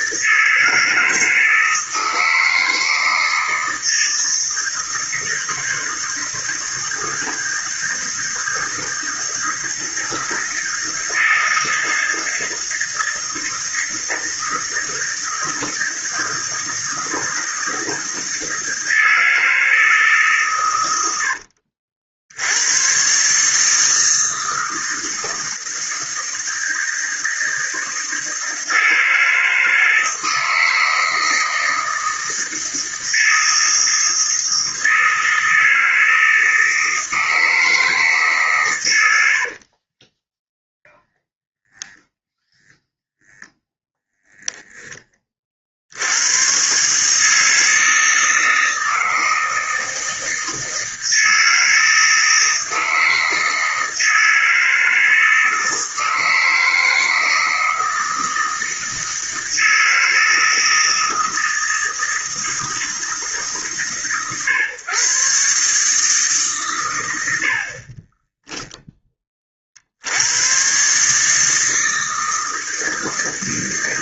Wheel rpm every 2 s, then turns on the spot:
160, 160, 160, 160, 160, 160, 160, 160, 160, 160, 110, 110, 160, 160, 160, 160, 160, 160, 160, 110, 0, 0, 20, 130, 160, 160, 160, 160, 160, 160, 160, 160, 130, 110, 10, 130, 160.
none